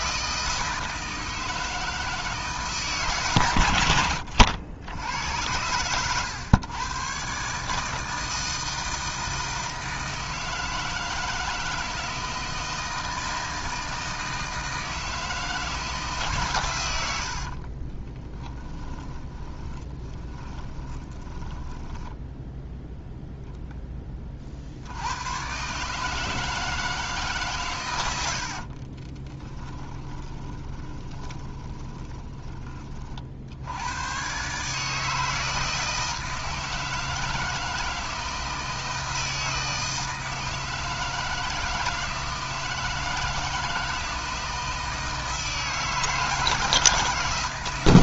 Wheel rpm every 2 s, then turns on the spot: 160, 150, 80, 110, 160, 160, 160, 160, 110, 10, 20, 0, 80, 160, 40, 20, 30, 150, 160, 160, 160, 160, 160, 160.
18-22 28-32